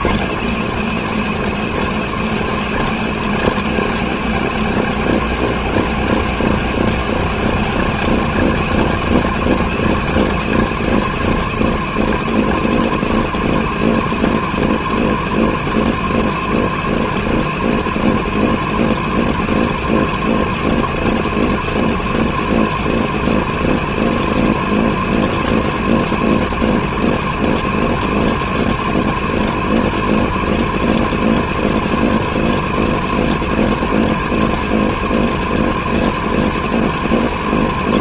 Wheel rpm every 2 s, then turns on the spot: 220, 240, 240, 240, 240, 240, 230, 230, 230, 230, 230, 230, 230, 230, 230, 230, 230, 230, 220.
none